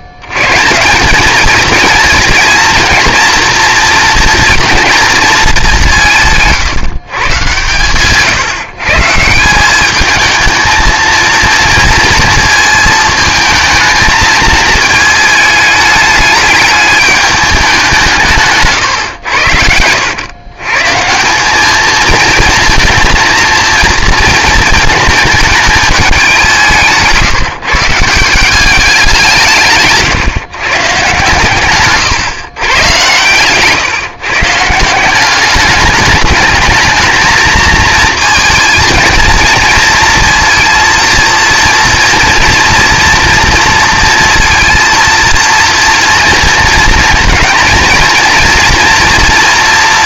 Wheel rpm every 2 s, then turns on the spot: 150, 230, 230, 150, 140, 220, 220, 220, 210, 140, 130, 230, 220, 180, 190, 130, 130, 160, 220, 230, 230, 230, 230, 230, 230.
18-20